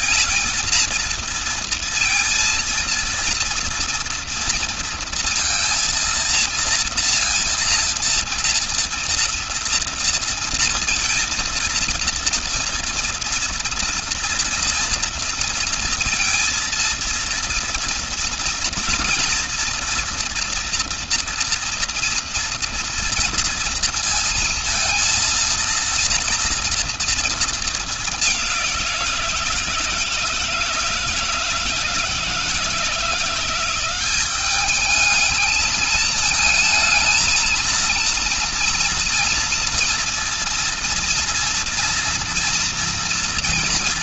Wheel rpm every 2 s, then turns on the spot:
230, 230, 230, 230, 230, 230, 230, 230, 230, 230, 230, 230, 230, 230, 190, 160, 160, 210, 220, 230, 230, 230.
none